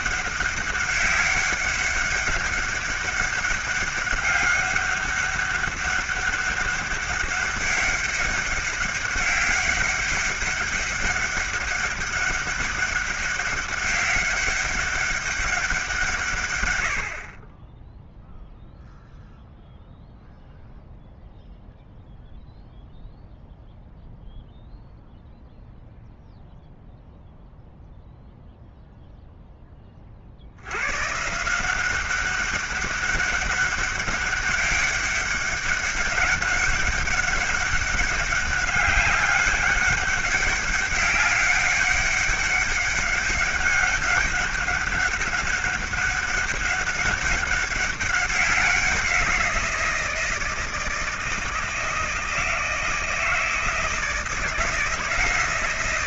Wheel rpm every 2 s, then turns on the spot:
200, 200, 200, 200, 200, 200, 200, 200, 120, 0, 0, 0, 0, 0, 0, 80, 200, 200, 200, 190, 190, 200, 200, 200, 190, 160, 160, 160.
none